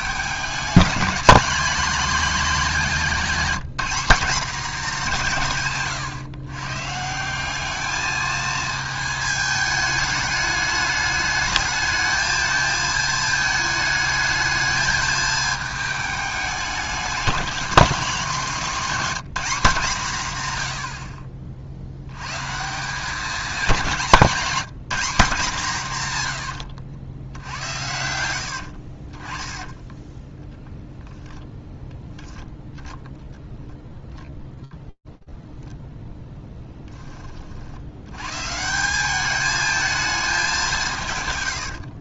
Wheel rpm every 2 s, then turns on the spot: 210, 220, 220, 140, 220, 210, 220, 220, 210, 200, 90, 160, 200, 80, 60, 0, 0, 0, 30, 200, 130.
26-30 40-42